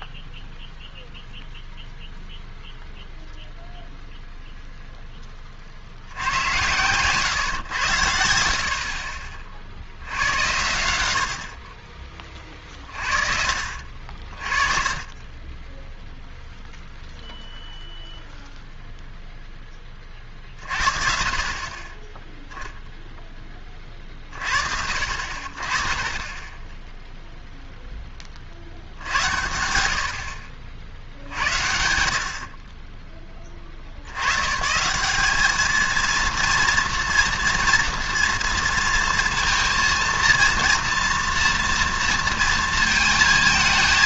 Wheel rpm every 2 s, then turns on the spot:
0, 0, 0, 110, 60, 90, 30, 40, 0, 0, 40, 0, 50, 10, 50, 60, 50, 130, 230, 230, 230, 230.
none